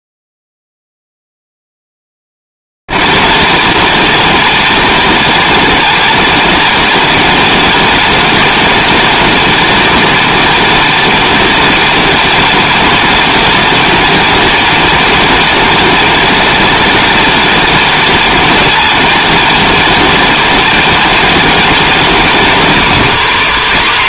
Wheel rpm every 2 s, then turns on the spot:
260, 260, 260, 260, 260, 260, 260, 270, 260, 260, 260, 250.
none